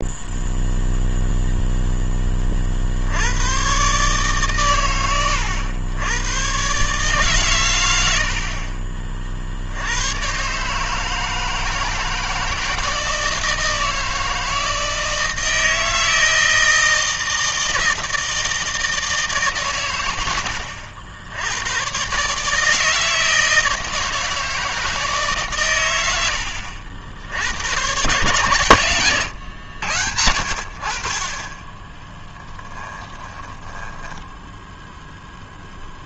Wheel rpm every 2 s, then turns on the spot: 0, 30, 130, 120, 60, 130, 160, 160, 160, 160, 90, 150, 160, 90, 120, 60, 20, 0.
32-34